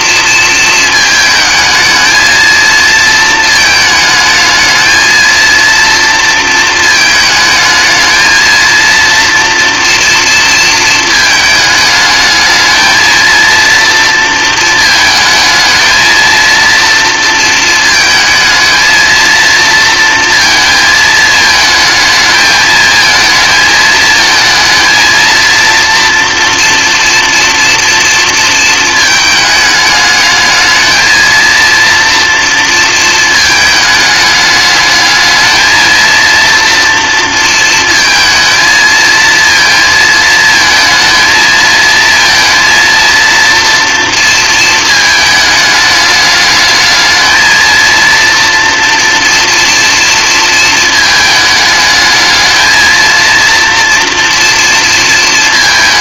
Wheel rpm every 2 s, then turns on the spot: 230, 220, 220, 230, 230, 230, 220, 230, 230, 230, 230, 220, 220, 230, 230, 220, 230, 210, 230, 230, 220, 230, 230, 210, 230, 230, 220, 230.
none